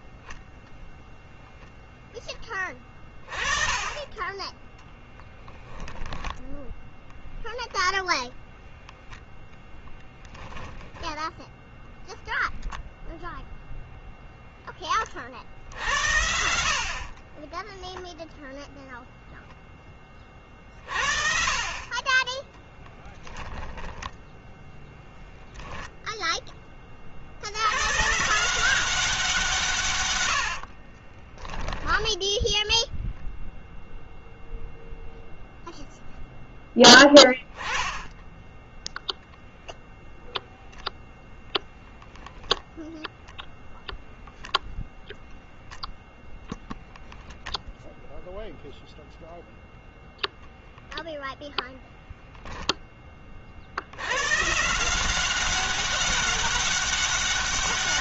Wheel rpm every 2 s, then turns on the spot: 0, 30, 10, 0, 0, 10, 0, 30, 40, 0, 50, 0, 0, 40, 180, 30, 0, 0, 10, 0, 0, 20, 0, 10, 0, 0, 20, 170, 200.
16-18 30-32 46-48